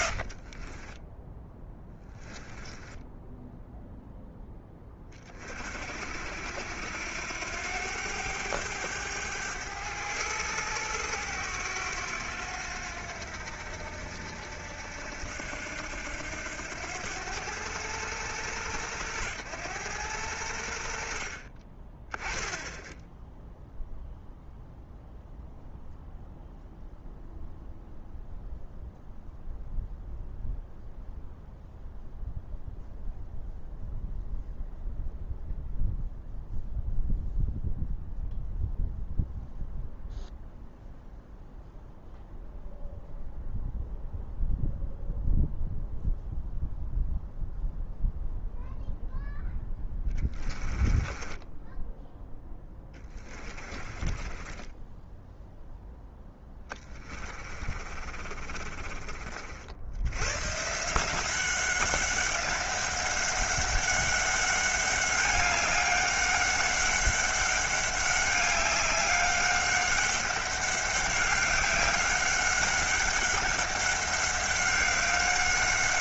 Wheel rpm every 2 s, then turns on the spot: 30, 10, 10, 80, 100, 90, 90, 80, 90, 110, 80, 10, 0, 0, 0, 0, 0, 0, 0, 0, 0, 0, 0, 0, 0, 20, 10, 10, 20, 40, 150, 190, 200, 200, 200, 200, 190, 190.
0-4 50-60